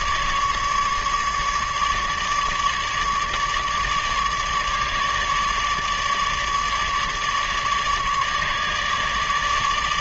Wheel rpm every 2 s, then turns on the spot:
150, 150, 150, 150, 150.
none